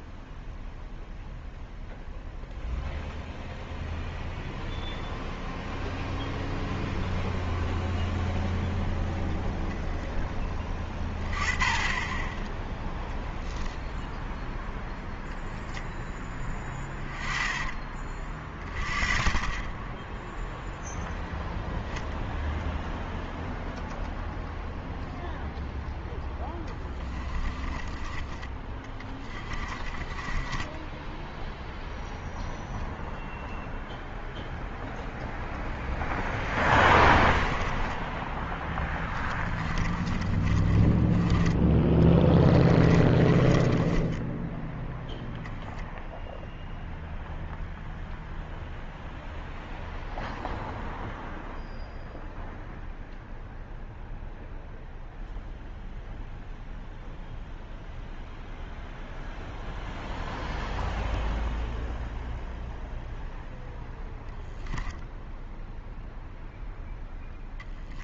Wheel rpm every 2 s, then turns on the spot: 0, 0, 0, 0, 0, 10, 0, 0, 10, 20, 0, 0, 0, 10, 20, 10, 0, 0, 10, 10, 20, 20, 10, 0, 0, 0, 0, 0, 0, 0, 0, 0, 0, 0.
16-18 26-32 36-44